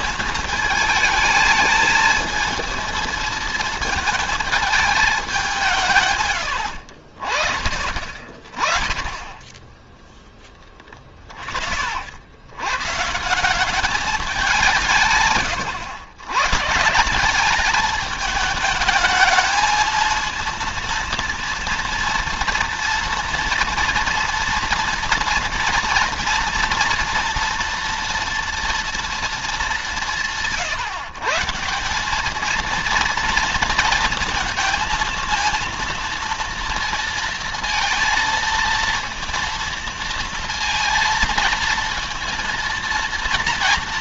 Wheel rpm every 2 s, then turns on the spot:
220, 230, 220, 70, 50, 20, 130, 170, 150, 220, 230, 230, 230, 230, 230, 150, 220, 230, 230, 230, 230, 230.
none